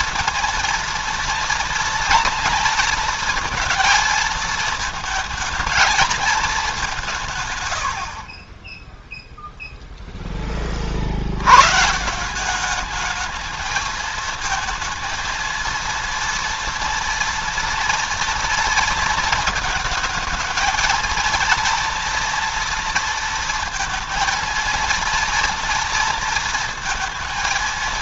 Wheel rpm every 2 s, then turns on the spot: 230, 230, 220, 210, 20, 30, 200, 220, 230, 230, 220, 230, 230, 230.
none